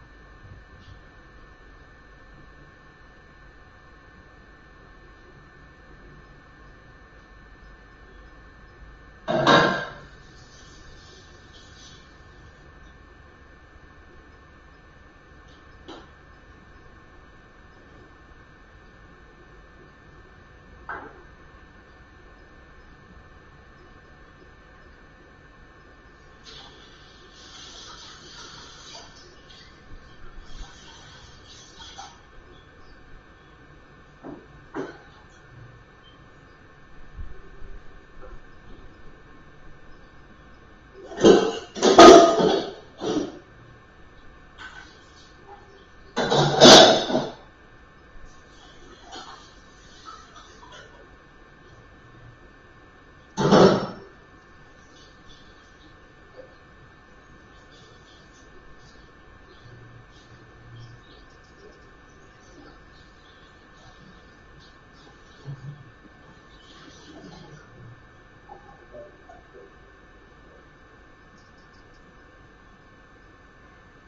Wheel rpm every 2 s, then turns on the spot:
0, 0, 0, 0, 0, 0, 0, 0, 0, 0, 0, 0, 0, 0, 0, 0, 0, 0, 0, 0, 0, 0, 0, 0, 0, 0, 0, 0, 0, 0, 0, 0, 0, 0, 0, 0, 0.
none